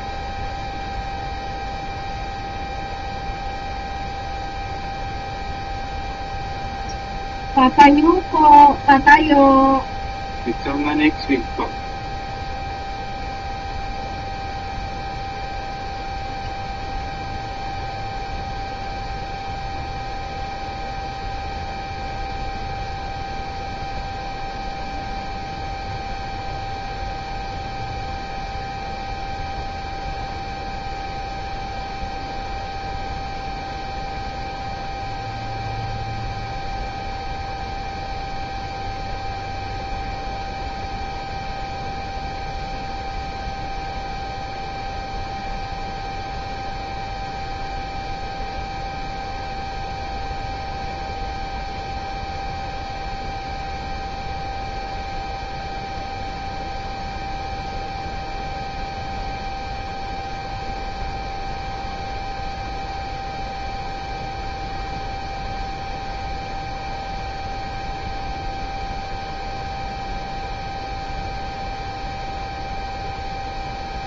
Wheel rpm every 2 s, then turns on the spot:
0, 0, 0, 0, 0, 0, 0, 0, 0, 0, 0, 0, 0, 0, 0, 0, 0, 0, 0, 0, 0, 0, 0, 0, 0, 0, 0, 0, 0, 0, 0, 0, 0, 0, 0, 0, 0.
none